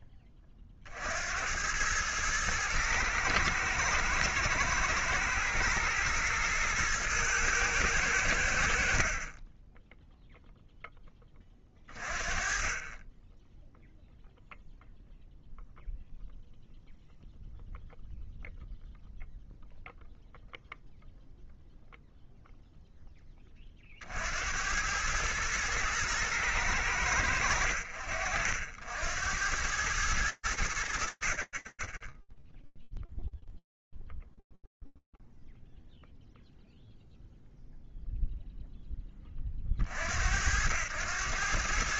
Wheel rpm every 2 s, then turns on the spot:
10, 100, 110, 110, 100, 10, 30, 0, 0, 0, 0, 0, 20, 110, 70, 90, 10, 0, 0, 60, 80.
none